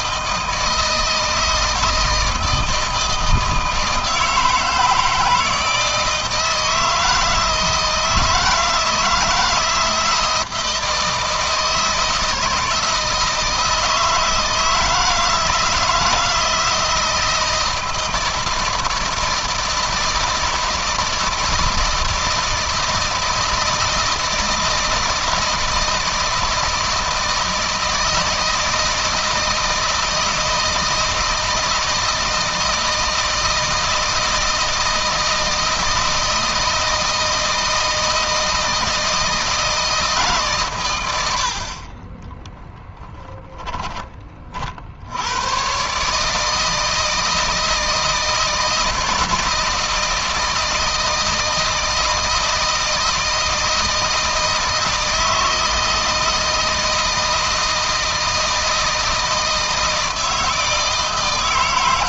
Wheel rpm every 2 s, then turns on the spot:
160, 160, 160, 160, 160, 160, 160, 160, 160, 160, 160, 160, 160, 160, 160, 160, 160, 160, 160, 160, 120, 10, 60, 160, 160, 160, 160, 160, 160, 160, 160.
42-44